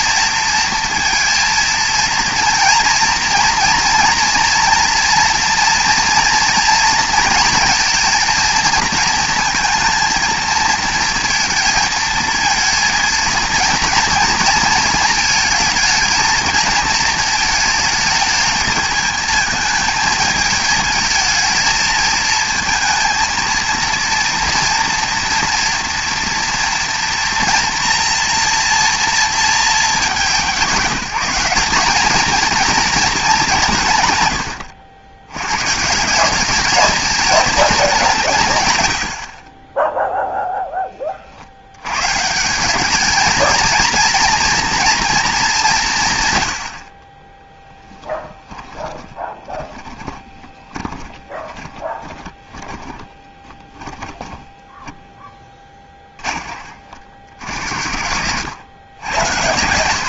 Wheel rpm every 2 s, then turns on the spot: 230, 230, 230, 230, 230, 230, 230, 220, 220, 220, 220, 220, 230, 230, 230, 190, 230, 100, 210, 130, 10, 190, 230, 70, 10, 20, 20, 10, 30, 90.
48-56